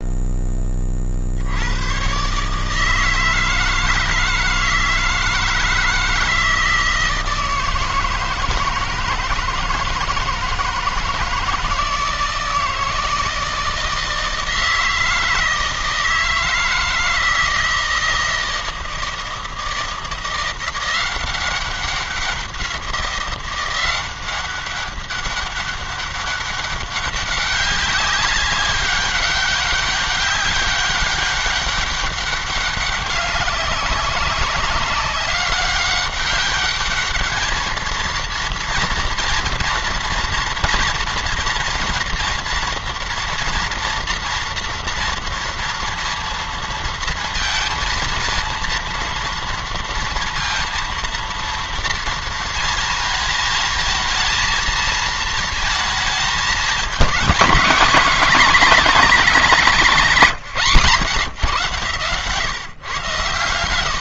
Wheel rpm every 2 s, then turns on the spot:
30, 160, 160, 160, 160, 160, 160, 160, 160, 160, 180, 180, 190, 200, 200, 200, 200, 200, 210, 230, 230, 230, 230, 230, 230, 240, 230, 220, 220, 240, 170, 120.
none